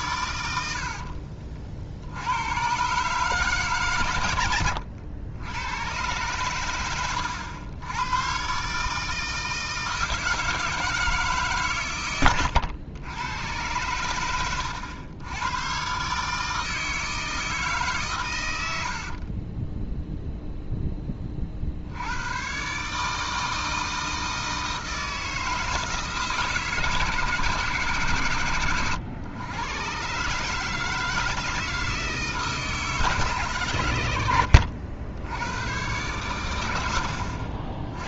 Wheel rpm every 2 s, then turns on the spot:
70, 110, 100, 110, 140, 160, 100, 90, 160, 80, 0, 130, 160, 150, 110, 150, 160, 60, 80.
0-2 4-6 18-20